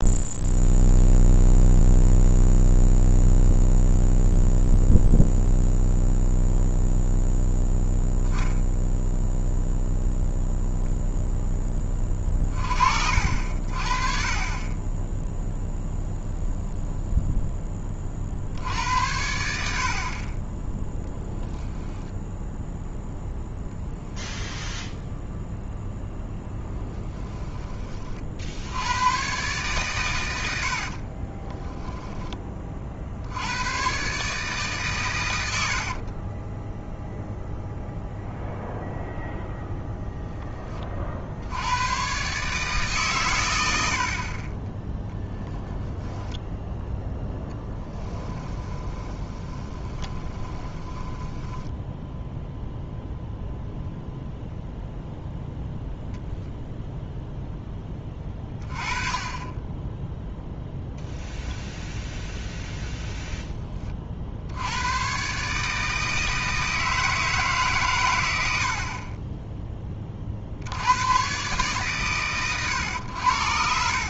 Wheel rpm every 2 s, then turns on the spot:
0, 0, 0, 0, 0, 0, 40, 30, 0, 70, 10, 0, 0, 10, 80, 80, 30, 140, 10, 0, 20, 140, 20, 10, 10, 20, 0, 0, 0, 20, 0, 0, 90, 160, 60, 70, 110.
30-32 36-38 44-52